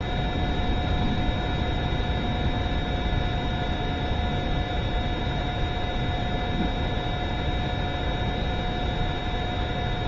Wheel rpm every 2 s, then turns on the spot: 0, 0, 0, 0, 0.
none